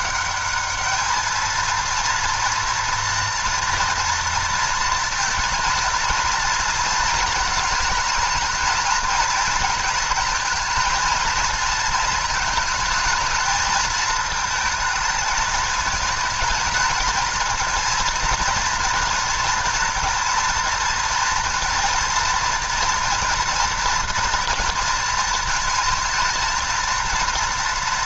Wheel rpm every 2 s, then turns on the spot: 210, 230, 230, 230, 220, 230, 220, 220, 220, 230, 230, 230, 230, 230.
none